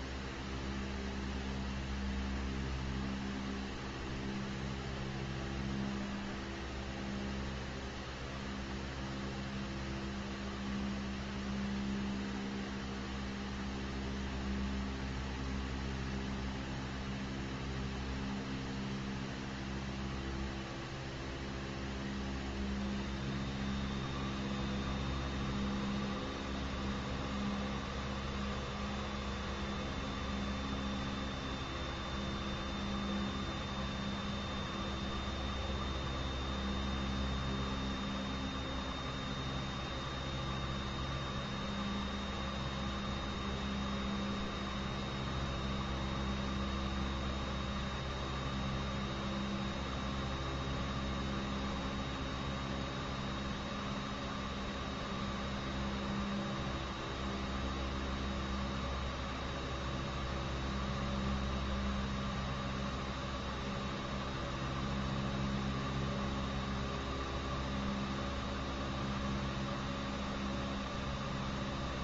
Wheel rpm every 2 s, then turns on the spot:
0, 0, 0, 0, 0, 0, 0, 0, 0, 0, 0, 0, 0, 0, 0, 0, 0, 0, 0, 0, 0, 0, 0, 0, 0, 0, 0, 0, 0, 0, 0, 0, 0, 0, 0, 0.
none